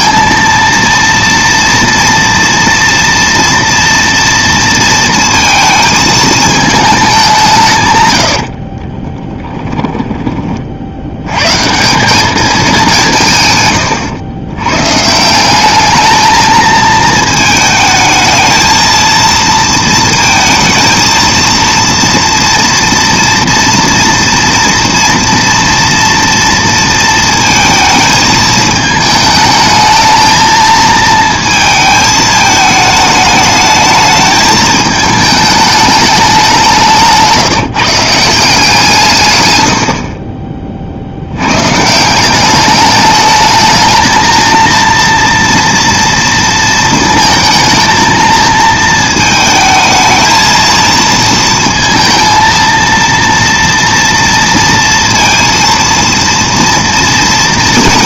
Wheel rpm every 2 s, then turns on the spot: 230, 230, 230, 200, 30, 90, 180, 140, 220, 230, 230, 230, 230, 230, 220, 220, 210, 210, 160, 150, 70, 210, 230, 230, 220, 230, 230, 230, 240.
8-10